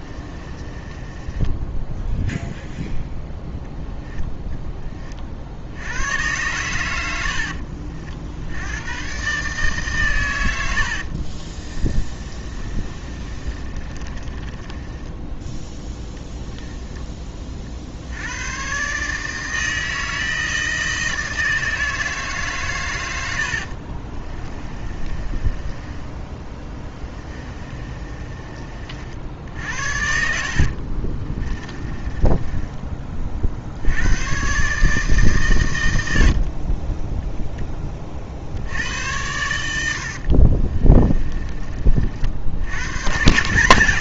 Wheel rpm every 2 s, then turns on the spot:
20, 0, 10, 100, 90, 90, 30, 20, 10, 120, 160, 130, 30, 20, 40, 60, 20, 140, 30, 70, 30, 100.
0-2 12-16 24-28 30-34 40-42